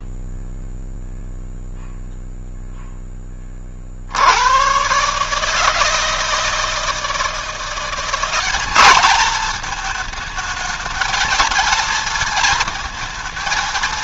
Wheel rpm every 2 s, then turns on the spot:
0, 0, 120, 160, 200, 220, 230.
none